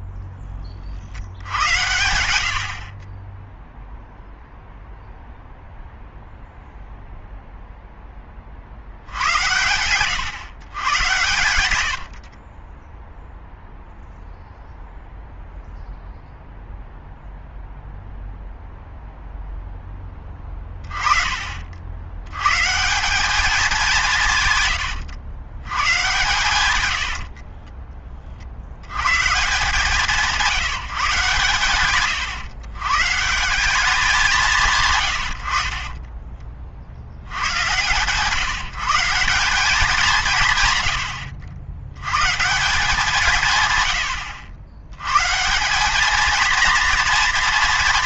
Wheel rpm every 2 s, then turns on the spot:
20, 80, 0, 0, 60, 120, 30, 0, 0, 0, 30, 130, 130, 110, 70, 170, 130, 170, 30, 150, 110, 170, 100, 230.
12-14